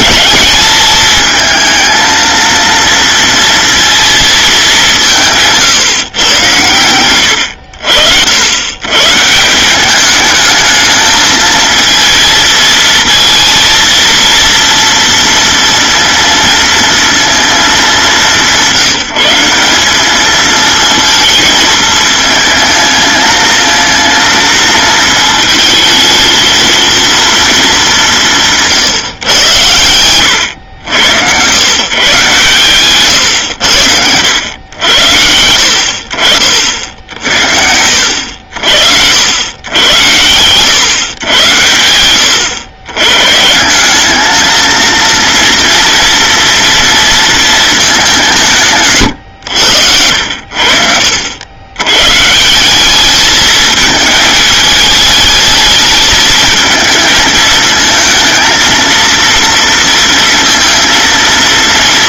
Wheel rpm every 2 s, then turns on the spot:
220, 230, 210, 100, 120, 220, 220, 230, 230, 180, 220, 220, 220, 230, 140, 100, 130, 90, 60, 60, 120, 110, 230, 230, 130, 70, 190, 210, 220, 230, 230.
none